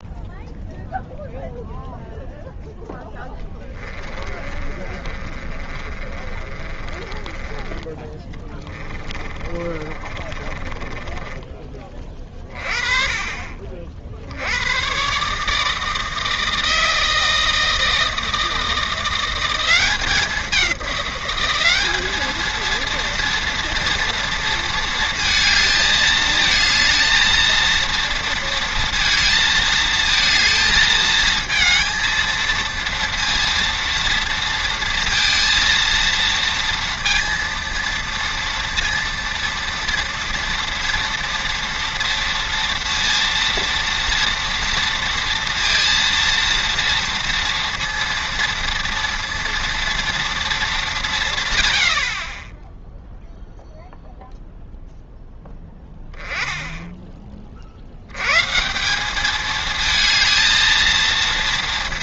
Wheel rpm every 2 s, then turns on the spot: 0, 0, 30, 30, 20, 20, 30, 90, 160, 160, 190, 220, 230, 220, 230, 220, 230, 230, 230, 230, 230, 230, 230, 230, 230, 220, 10, 0, 10, 140, 220.
4-12